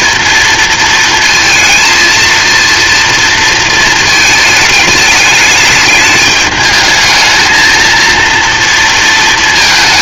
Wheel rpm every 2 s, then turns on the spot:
230, 230, 220, 210, 230.
none